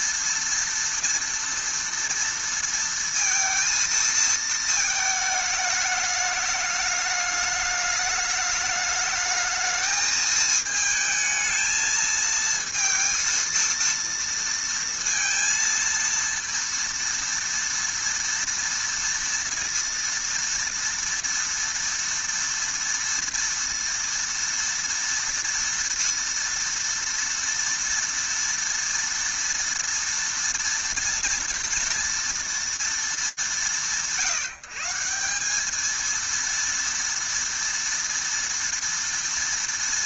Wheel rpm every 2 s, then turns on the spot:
230, 230, 220, 210, 210, 220, 230, 230, 230, 230, 230, 230, 230, 230, 230, 230, 230, 160, 230, 230.
none